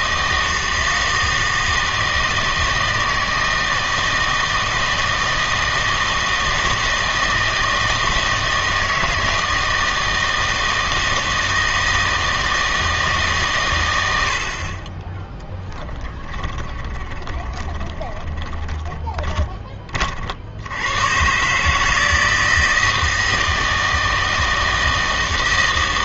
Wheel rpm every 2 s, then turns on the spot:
160, 160, 160, 160, 160, 160, 160, 40, 20, 20, 90, 160, 160.
16-20